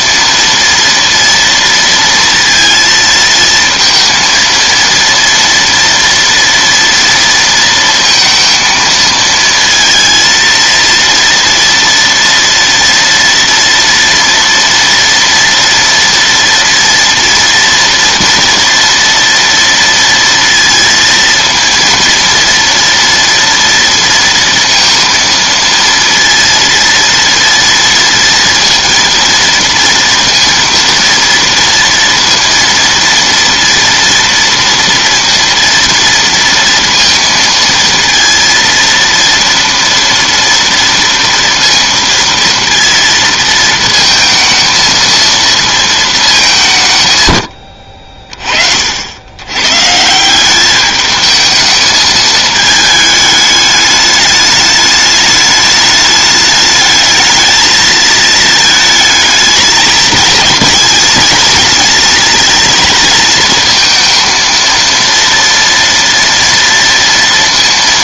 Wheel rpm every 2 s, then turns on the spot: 230, 230, 230, 240, 230, 230, 230, 230, 230, 230, 230, 230, 230, 230, 230, 230, 230, 230, 230, 230, 230, 230, 230, 180, 40, 200, 220, 210, 210, 220, 220, 230, 230, 230.
none